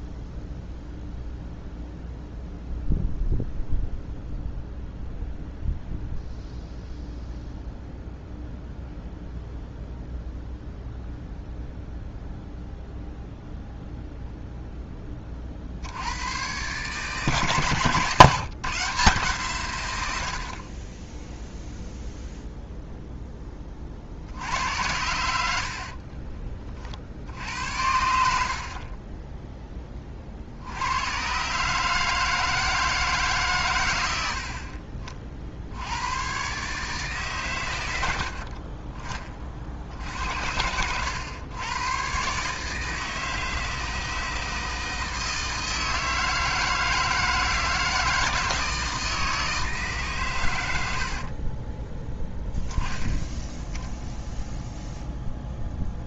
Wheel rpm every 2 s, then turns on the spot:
0, 0, 0, 0, 0, 0, 0, 0, 120, 150, 50, 0, 70, 30, 50, 70, 160, 50, 130, 50, 80, 140, 160, 160, 160, 100, 10, 0.
38-40